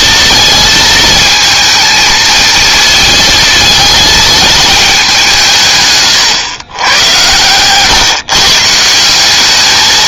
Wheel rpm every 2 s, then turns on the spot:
230, 220, 210, 110, 160.
none